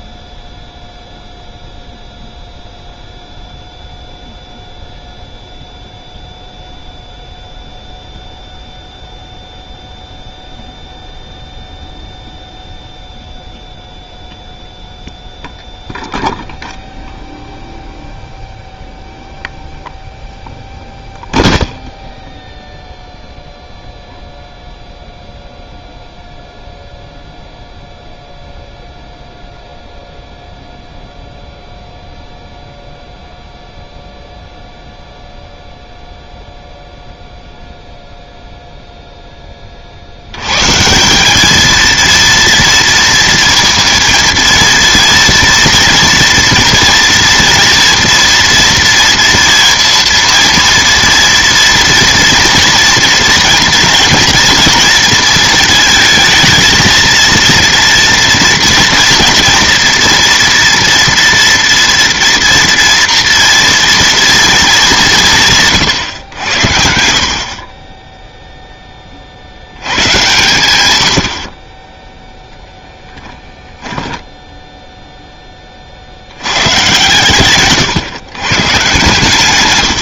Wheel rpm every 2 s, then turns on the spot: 0, 0, 0, 0, 0, 0, 0, 0, 0, 0, 0, 0, 0, 0, 0, 0, 0, 0, 0, 0, 160, 230, 230, 230, 230, 230, 230, 230, 230, 230, 230, 230, 190, 70, 10, 110, 10, 10, 110, 130.
74-76